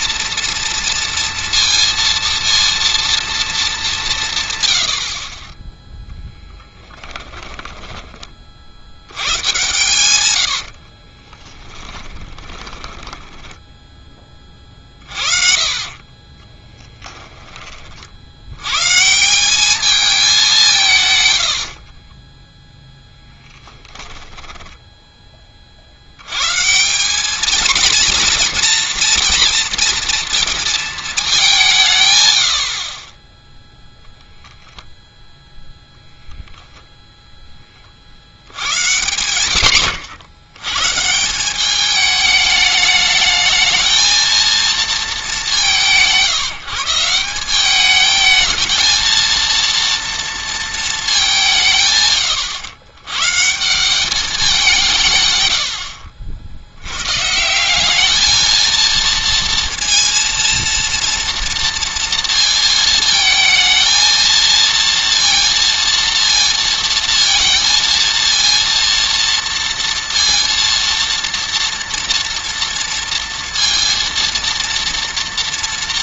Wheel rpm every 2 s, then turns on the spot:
230, 230, 100, 10, 70, 60, 10, 30, 10, 120, 160, 10, 10, 170, 230, 230, 60, 0, 0, 110, 110, 210, 230, 170, 220, 230, 110, 160, 90, 230, 230, 230, 230, 230, 230, 230, 230, 230.
6-8 10-14 16-18 24-26